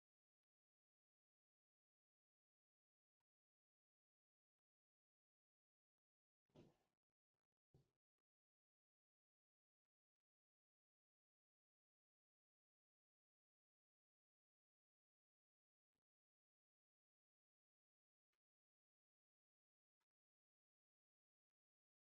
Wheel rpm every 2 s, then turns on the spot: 0, 0, 0, 0, 0, 0, 0, 0, 0, 0, 0.
none